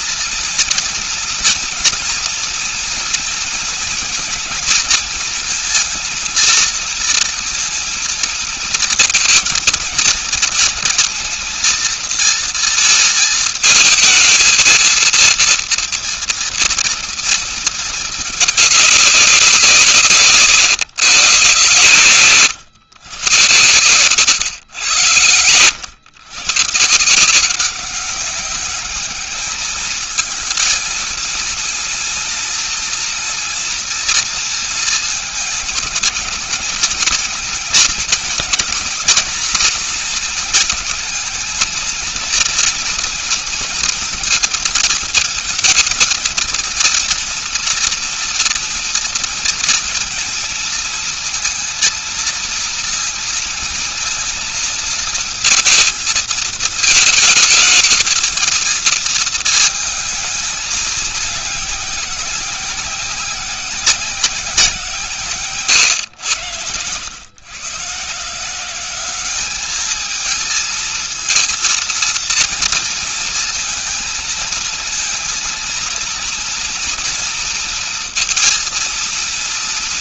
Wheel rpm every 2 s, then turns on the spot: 230, 240, 230, 230, 220, 230, 230, 230, 230, 200, 130, 120, 110, 160, 200, 220, 240, 230, 220, 240, 220, 230, 220, 230, 230, 230, 230, 230, 220, 230, 210, 190, 170, 110, 190, 230, 230, 220, 230, 230.
none